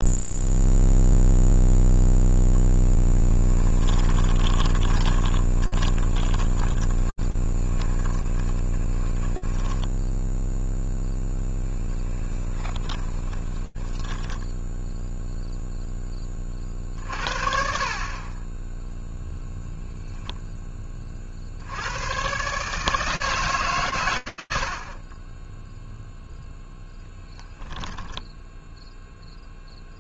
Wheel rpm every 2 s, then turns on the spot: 0, 0, 20, 20, 30, 0, 10, 10, 40, 20, 30, 150, 70, 0, 0.
4-10 12-16